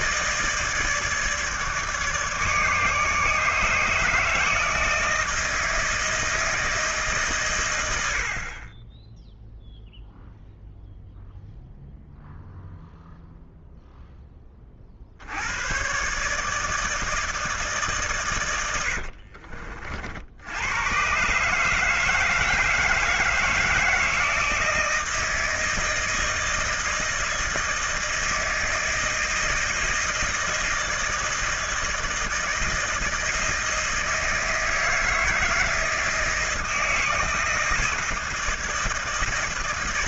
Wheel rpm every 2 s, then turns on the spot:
160, 150, 160, 160, 40, 0, 0, 20, 150, 110, 90, 160, 160, 160, 160, 160, 160, 160, 160, 160.
none